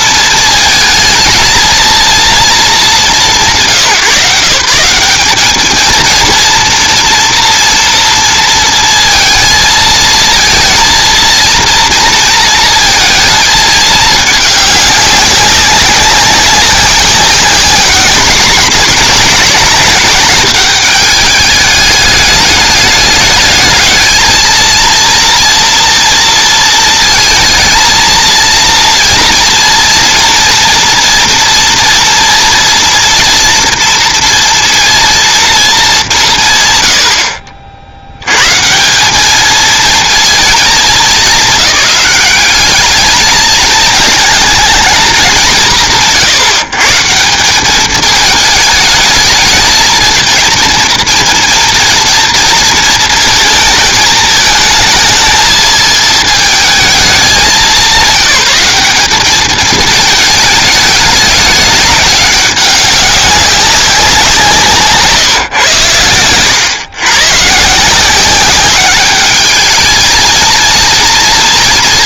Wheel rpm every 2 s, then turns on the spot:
220, 230, 160, 230, 230, 230, 230, 210, 190, 200, 210, 210, 230, 230, 230, 230, 230, 230, 120, 150, 220, 200, 220, 140, 220, 230, 230, 220, 220, 200, 210, 200, 170, 110, 190, 230.
none